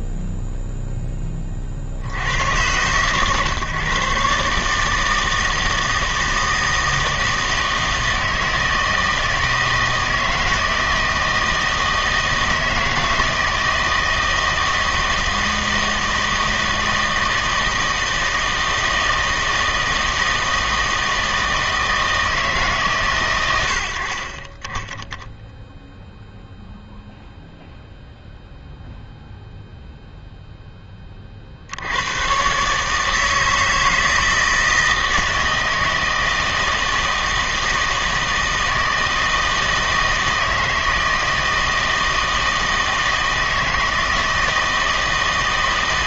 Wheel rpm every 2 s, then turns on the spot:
0, 110, 150, 160, 160, 160, 160, 160, 160, 160, 160, 150, 10, 0, 0, 10, 140, 160, 160, 160, 160, 160, 160.
none